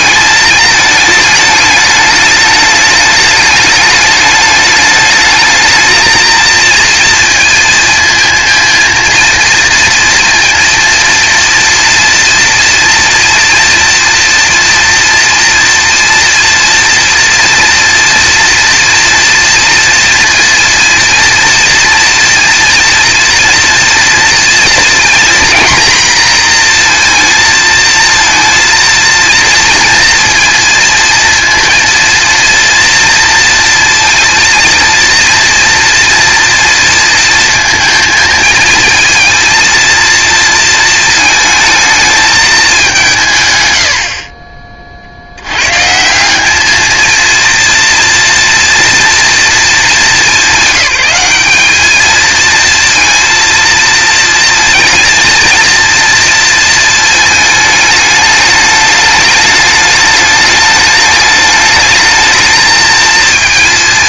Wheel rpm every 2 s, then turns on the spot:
210, 210, 210, 230, 230, 230, 230, 230, 230, 230, 230, 230, 230, 230, 230, 230, 230, 230, 230, 230, 230, 210, 40, 210, 230, 200, 230, 230, 230, 210, 210, 220.
none